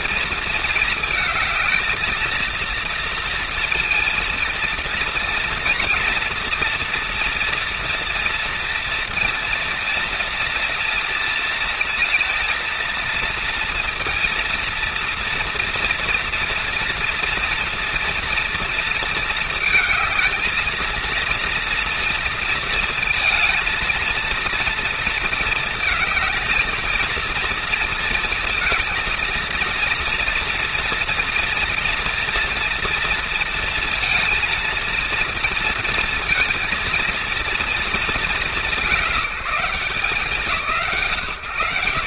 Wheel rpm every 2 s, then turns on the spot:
230, 230, 230, 240, 230, 230, 230, 230, 230, 230, 230, 230, 230, 220, 230, 230, 230, 230, 230, 200, 150.
none